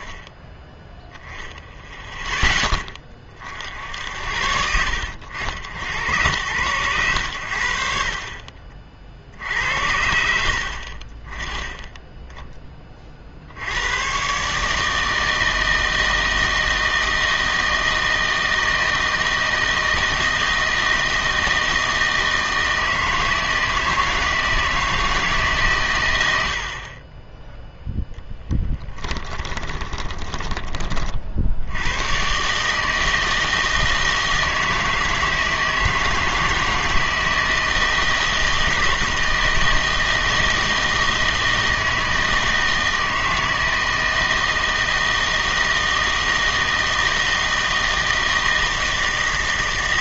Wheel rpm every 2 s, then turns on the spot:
10, 10, 70, 100, 40, 50, 20, 150, 160, 160, 160, 160, 160, 60, 10, 20, 150, 160, 160, 160, 160, 160, 160, 160, 160.
28-30